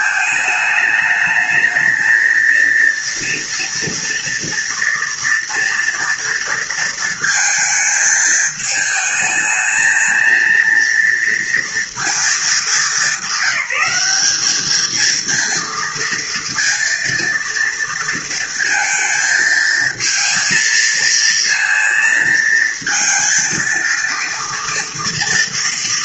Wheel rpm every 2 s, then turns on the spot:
210, 230, 230, 220, 220, 230, 200, 230, 230, 220, 230, 230, 230.
none